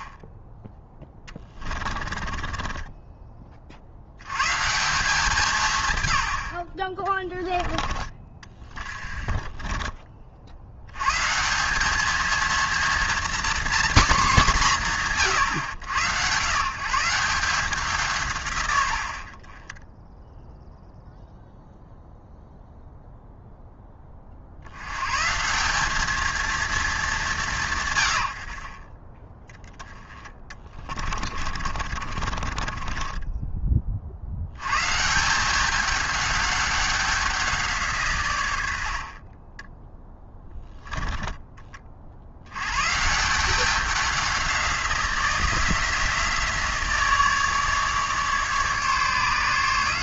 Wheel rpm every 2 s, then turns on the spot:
10, 20, 150, 70, 30, 70, 230, 210, 150, 110, 0, 0, 70, 220, 40, 20, 30, 120, 200, 90, 10, 100, 180, 160, 150.
2-4 8-10 30-34